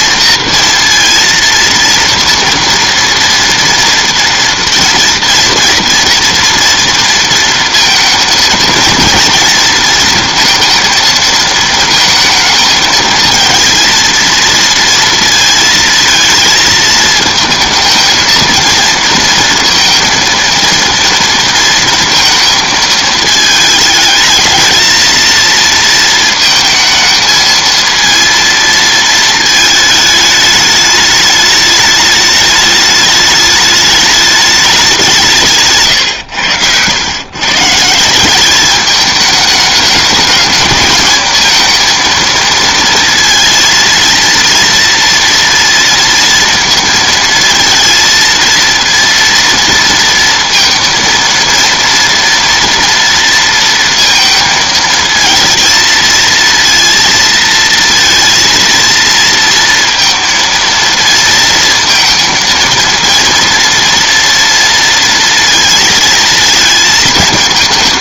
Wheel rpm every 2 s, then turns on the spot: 230, 230, 230, 230, 220, 230, 220, 230, 220, 230, 230, 220, 220, 230, 230, 210, 210, 200, 100, 210, 210, 230, 230, 230, 230, 230, 230, 220, 230, 230, 230, 230, 230, 220.
none